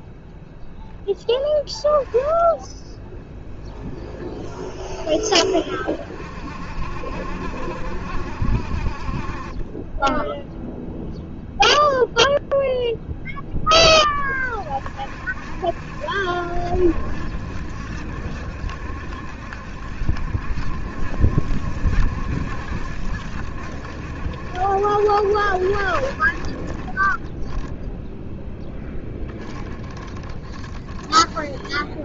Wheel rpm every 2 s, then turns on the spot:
0, 10, 20, 50, 50, 0, 0, 50, 70, 70, 70, 70, 70, 40, 10, 10.
none